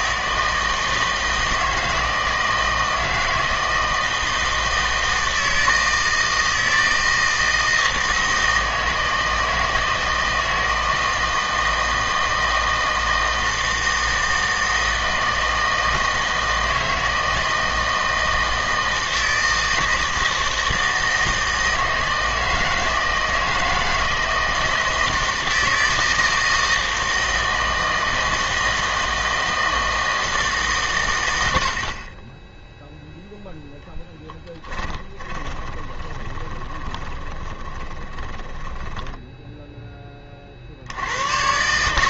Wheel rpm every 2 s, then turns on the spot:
160, 160, 160, 160, 160, 160, 160, 160, 160, 160, 160, 160, 160, 160, 160, 140, 0, 10, 20, 20, 60.
34-40